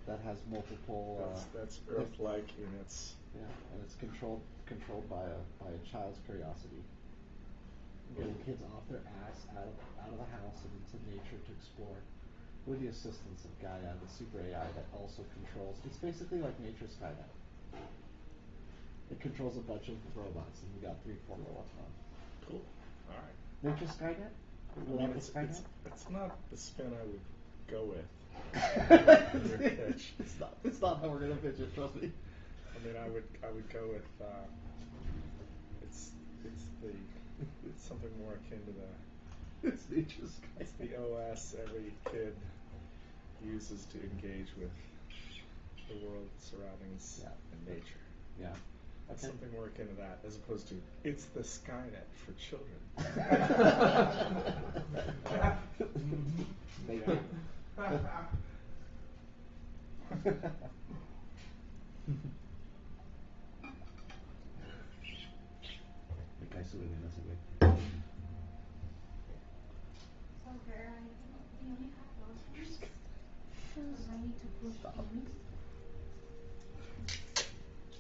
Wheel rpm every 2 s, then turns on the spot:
0, 0, 0, 0, 0, 0, 0, 0, 0, 0, 0, 0, 0, 0, 0, 0, 0, 0, 0, 0, 0, 0, 0, 0, 0, 0, 0, 0, 0, 0, 0, 0, 0, 0, 0, 0, 0, 0, 0.
none